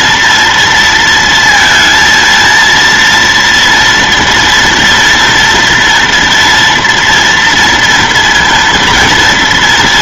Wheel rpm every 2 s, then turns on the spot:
230, 230, 230, 240, 230.
none